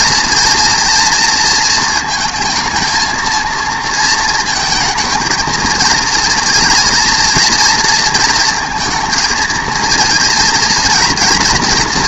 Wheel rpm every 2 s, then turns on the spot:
230, 220, 230, 230, 220, 230.
none